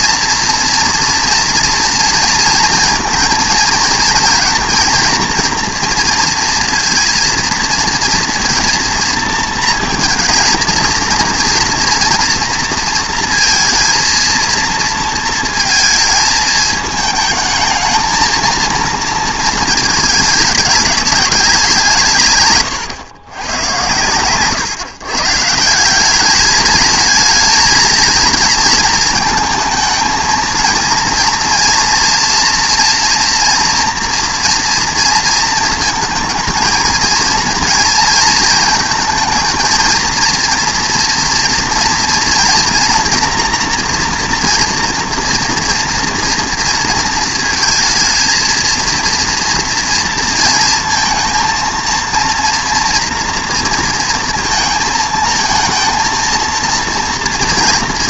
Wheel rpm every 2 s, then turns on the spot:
230, 230, 230, 230, 230, 230, 230, 230, 220, 230, 210, 120, 130, 220, 230, 230, 230, 230, 220, 230, 230, 240, 230, 230, 230, 230, 240, 230, 230.
none